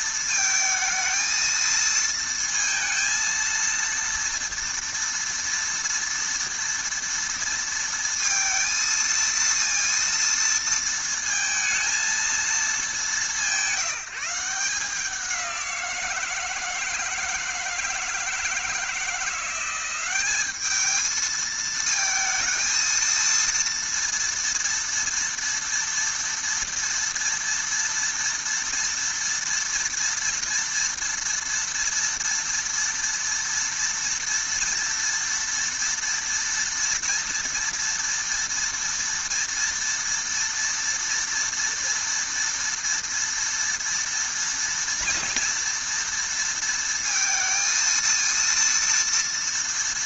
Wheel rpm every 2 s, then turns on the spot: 220, 230, 230, 230, 230, 230, 180, 180, 160, 170, 220, 230, 230, 240, 230, 230, 230, 230, 230, 230, 230, 230, 230, 230, 230.
none